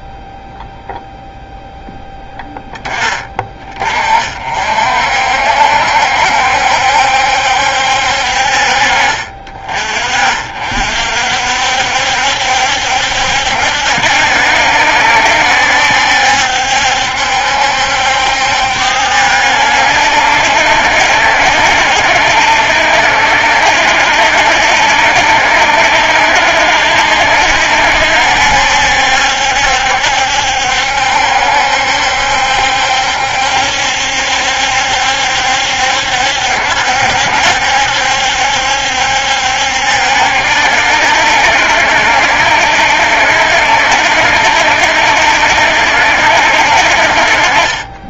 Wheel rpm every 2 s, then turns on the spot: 0, 10, 50, 70, 40, 50, 70, 70, 70, 70, 70, 70, 70, 70, 70, 70, 70, 70, 70, 70, 70, 70, 70, 60.
none